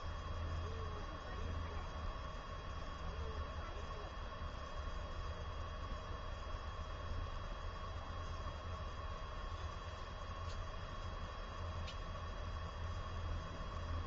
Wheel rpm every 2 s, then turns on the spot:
0, 0, 0, 0, 0, 0, 0.
none